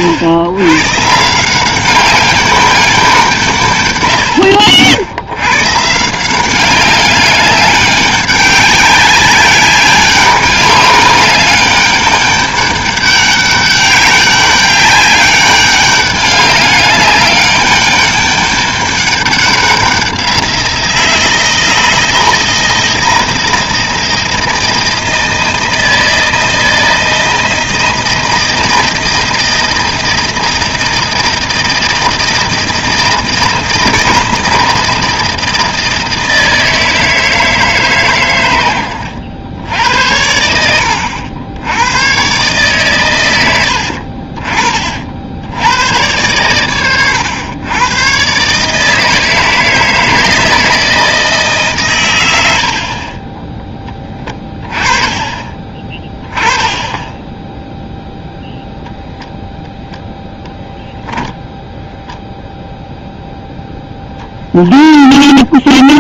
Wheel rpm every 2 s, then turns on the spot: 120, 200, 70, 190, 200, 200, 200, 200, 200, 200, 170, 160, 160, 160, 160, 160, 160, 160, 160, 100, 70, 130, 40, 110, 140, 160, 70, 20, 20, 0, 0, 0, 0.
none